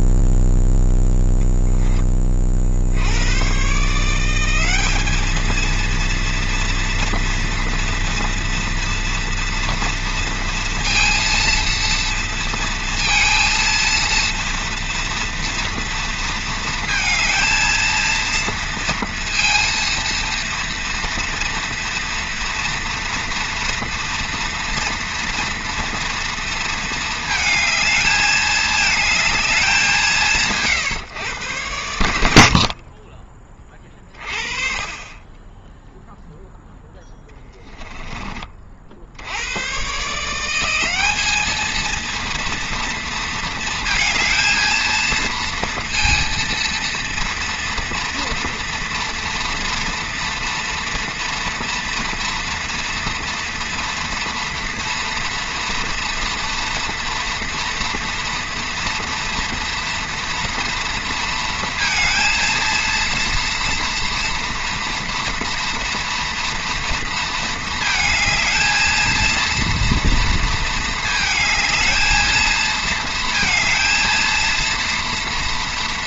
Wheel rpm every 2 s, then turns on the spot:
0, 50, 190, 230, 230, 230, 230, 230, 230, 230, 230, 230, 230, 230, 210, 150, 50, 40, 0, 30, 170, 230, 220, 230, 230, 230, 230, 230, 230, 230, 230, 230, 240, 230, 220, 220, 220, 230.
none